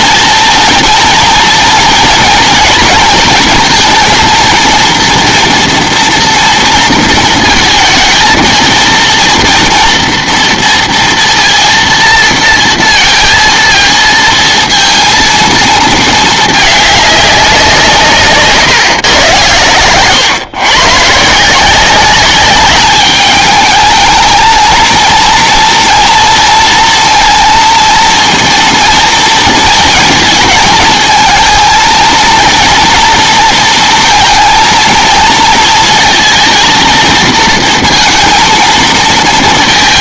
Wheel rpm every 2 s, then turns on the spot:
230, 230, 230, 230, 230, 230, 230, 230, 210, 140, 130, 200, 230, 230, 230, 220, 230, 230, 230, 230.
none